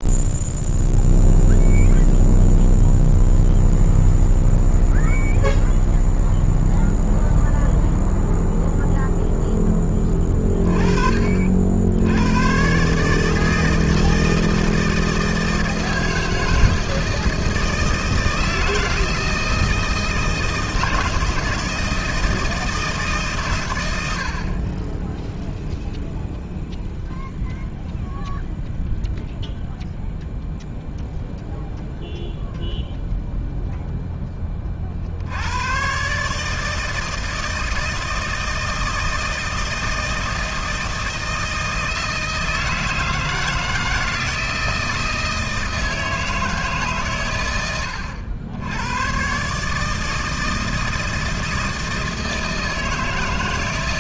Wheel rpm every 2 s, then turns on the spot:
0, 0, 0, 0, 0, 30, 120, 160, 160, 160, 160, 160, 40, 0, 0, 0, 0, 20, 150, 160, 160, 160, 160, 160, 90, 160, 160.
none